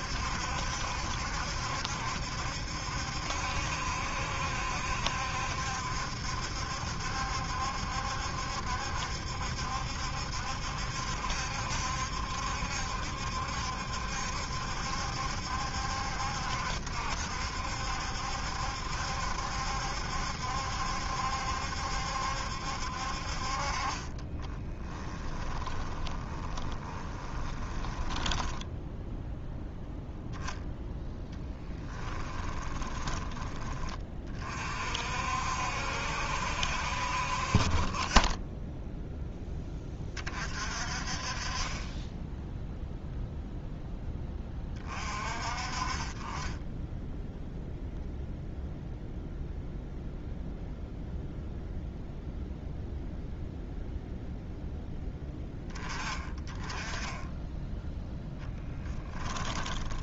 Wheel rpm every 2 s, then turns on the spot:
70, 70, 70, 70, 70, 70, 70, 70, 70, 70, 70, 60, 30, 20, 0, 0, 20, 50, 60, 0, 40, 0, 30, 10, 0, 0, 0, 10, 10, 10.
24-28 32-34 58-60